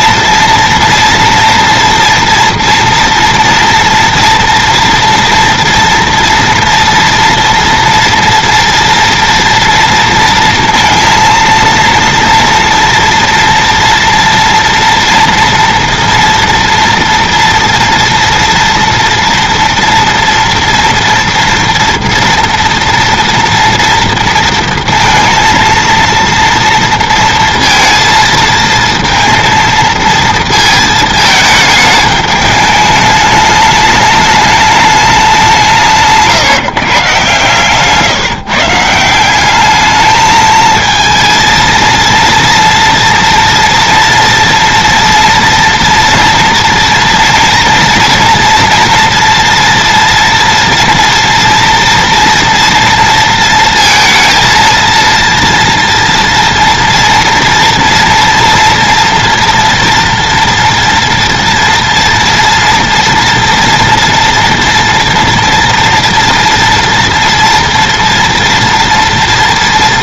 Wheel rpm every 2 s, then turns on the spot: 230, 230, 230, 230, 230, 230, 230, 230, 230, 230, 230, 230, 230, 230, 230, 220, 210, 210, 140, 160, 220, 230, 230, 230, 230, 230, 230, 230, 230, 240, 230, 230, 230, 230, 240.
none